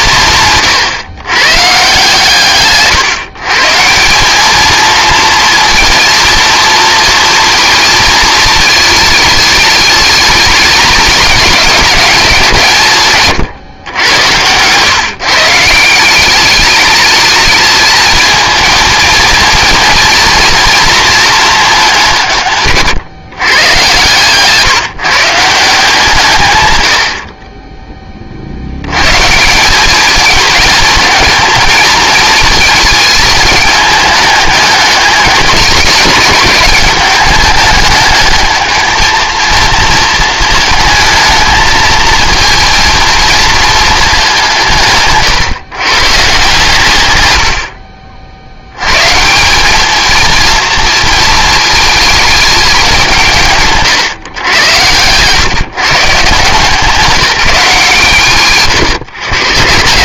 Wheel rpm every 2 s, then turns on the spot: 130, 140, 220, 230, 220, 200, 160, 130, 210, 230, 240, 140, 150, 90, 100, 210, 220, 210, 190, 220, 220, 230, 150, 120, 110, 230, 190, 110, 160, 130.
none